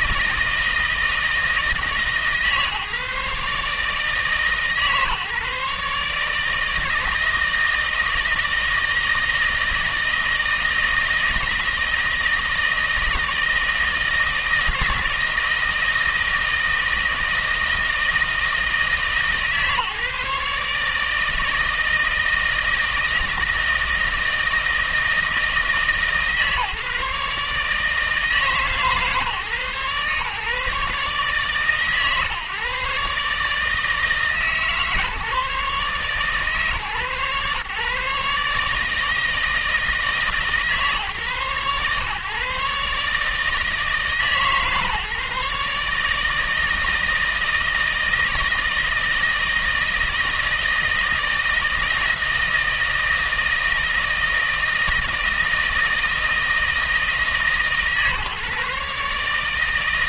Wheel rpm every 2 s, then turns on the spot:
160, 150, 150, 160, 160, 160, 160, 160, 160, 160, 160, 160, 160, 150, 150, 140, 140, 150, 140, 150, 150, 140, 150, 160, 160, 160, 160, 160, 160, 140.
none